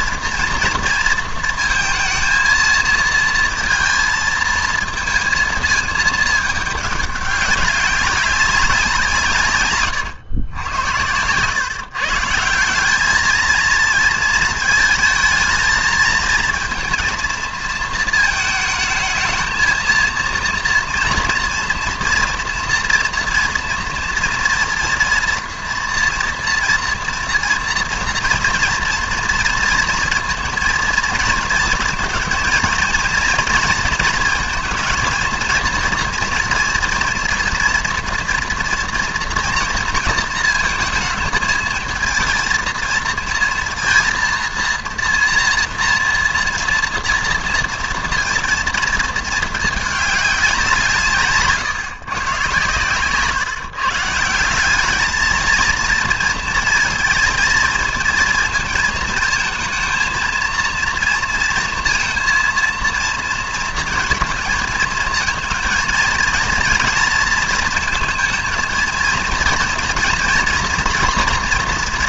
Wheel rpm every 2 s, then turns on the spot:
230, 230, 230, 210, 180, 100, 180, 230, 230, 220, 230, 230, 230, 230, 230, 230, 230, 220, 230, 230, 220, 230, 230, 230, 230, 190, 120, 190, 220, 230, 230, 230, 220, 230, 230, 240.
none